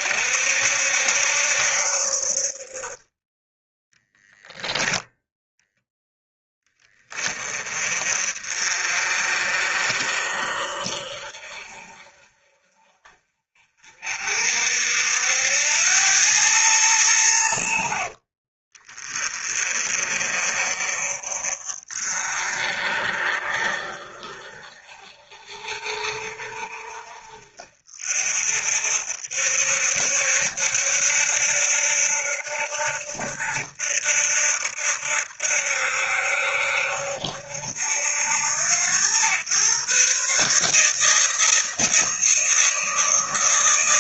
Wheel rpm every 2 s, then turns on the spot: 60, 40, 0, 20, 40, 50, 40, 60, 110, 40, 50, 50, 50, 50, 60, 70, 70, 70, 70, 90, 150, 160.
none